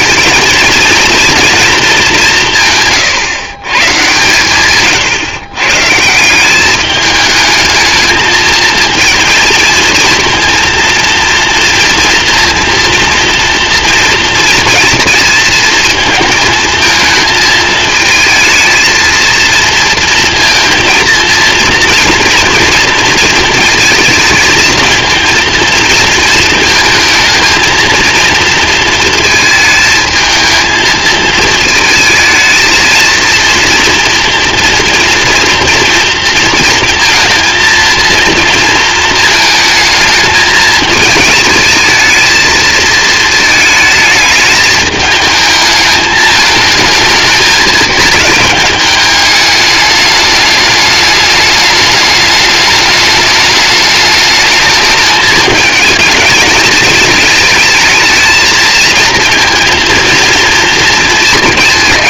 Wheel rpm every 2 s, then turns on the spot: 220, 140, 130, 210, 230, 230, 230, 220, 220, 230, 230, 230, 230, 220, 220, 220, 230, 230, 230, 220, 210, 220, 210, 220, 210, 210, 210, 210, 220, 230, 230.
none